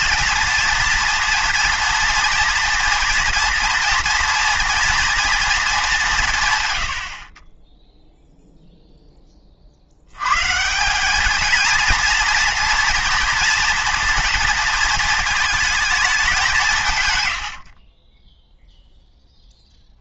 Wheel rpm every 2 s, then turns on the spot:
230, 230, 230, 120, 0, 160, 230, 230, 170, 0.
none